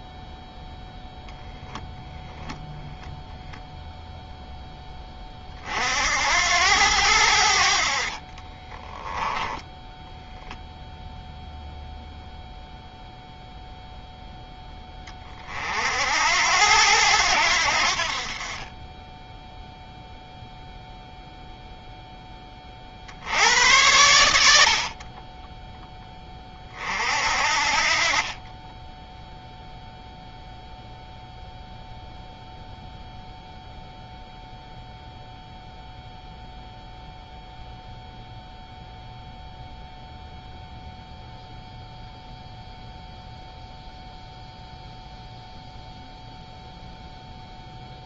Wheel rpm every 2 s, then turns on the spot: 10, 0, 10, 90, 20, 0, 0, 20, 90, 10, 0, 60, 40, 40, 10, 0, 0, 0, 0, 0, 0, 0, 0, 0.
8-10